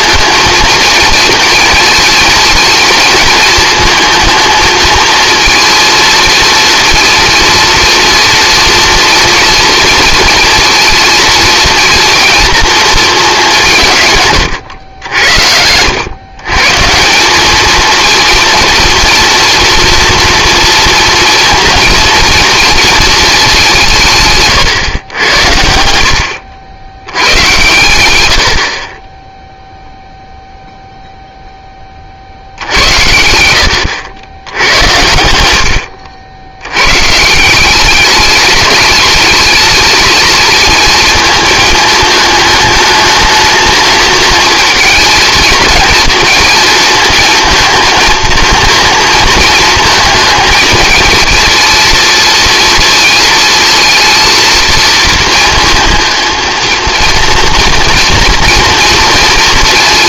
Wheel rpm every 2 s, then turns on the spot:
230, 230, 230, 230, 230, 230, 230, 110, 140, 230, 230, 230, 130, 80, 60, 0, 70, 90, 100, 210, 220, 220, 220, 230, 230, 220, 230, 220, 220, 230.
14-16